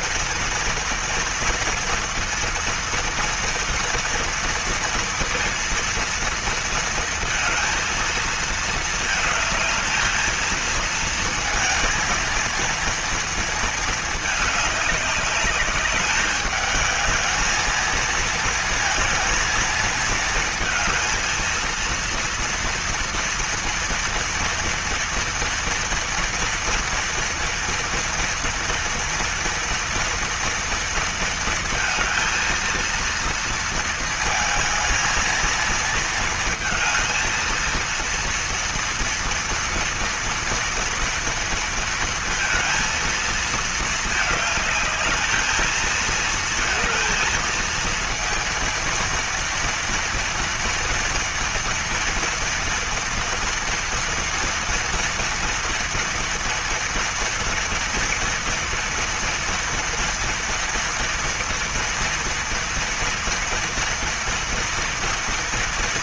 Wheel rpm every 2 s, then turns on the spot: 240, 230, 230, 230, 230, 220, 230, 210, 210, 230, 230, 230, 230, 230, 230, 230, 230, 220, 220, 230, 240, 230, 210, 230, 230, 230, 230, 230, 230, 230, 230, 230, 240.
none